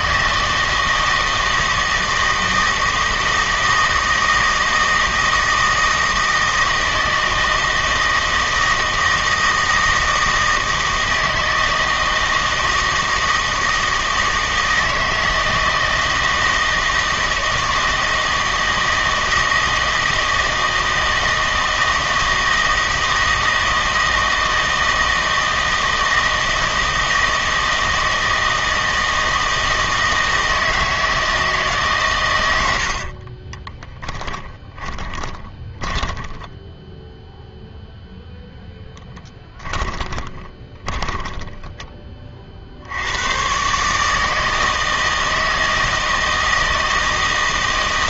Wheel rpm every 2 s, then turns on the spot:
160, 160, 160, 160, 160, 160, 160, 160, 160, 160, 160, 160, 160, 160, 160, 160, 80, 10, 10, 0, 20, 60, 160, 160.
34-38 40-42